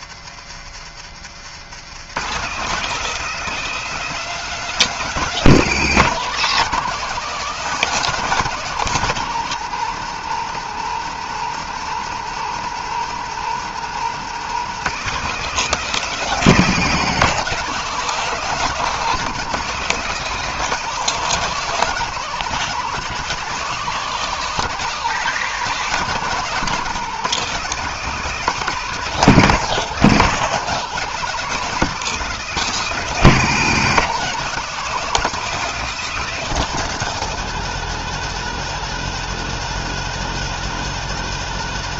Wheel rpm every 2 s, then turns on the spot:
130, 200, 190, 200, 180, 170, 170, 190, 180, 190, 190, 190, 190, 190, 180, 190, 180, 190, 190, 180, 180.
0-2